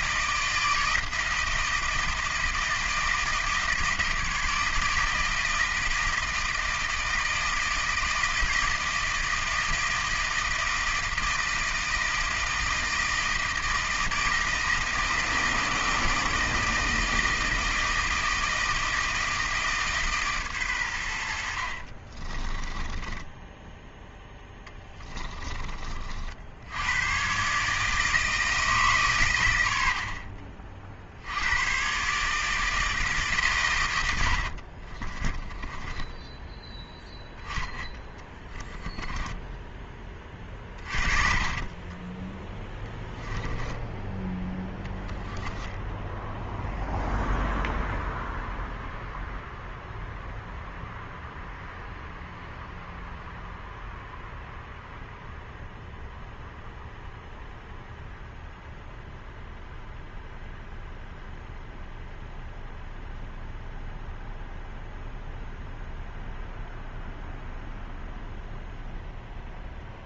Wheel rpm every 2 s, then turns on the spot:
160, 160, 160, 160, 160, 160, 160, 160, 160, 160, 110, 20, 10, 90, 150, 50, 160, 50, 10, 10, 30, 10, 10, 0, 0, 0, 0, 0, 0, 0, 0, 0, 0, 0, 0.
22-26 34-36 40-44